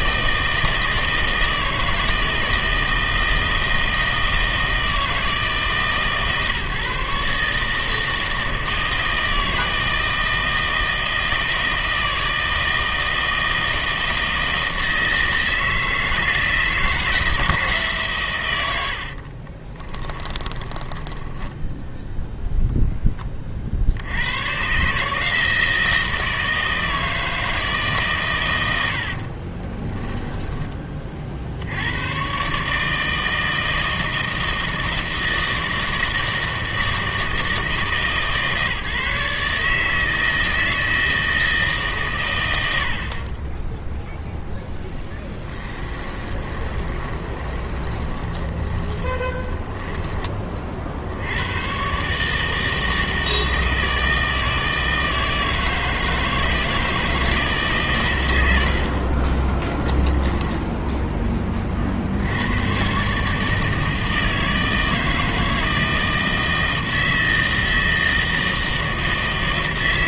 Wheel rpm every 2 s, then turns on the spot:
160, 160, 160, 150, 160, 160, 160, 160, 160, 90, 20, 0, 140, 160, 90, 20, 150, 160, 160, 150, 160, 80, 10, 20, 20, 50, 160, 160, 160, 60, 10, 120, 160, 160, 160.
20-22 46-50 60-62